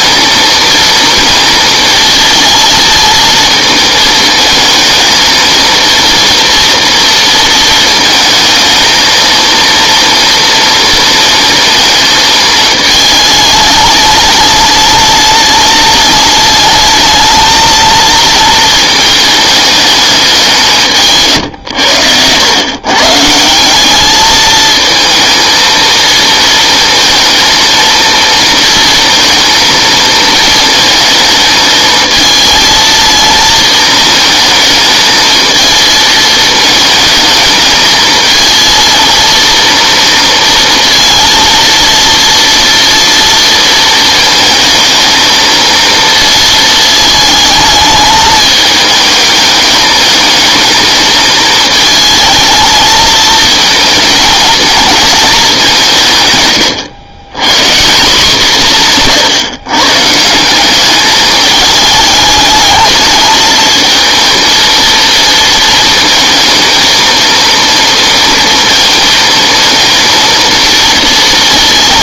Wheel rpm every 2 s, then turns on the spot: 230, 230, 220, 230, 220, 230, 220, 210, 210, 230, 180, 110, 220, 230, 230, 220, 220, 230, 220, 230, 230, 230, 220, 230, 220, 220, 220, 220, 110, 180, 190, 210, 230, 220, 230, 230.
none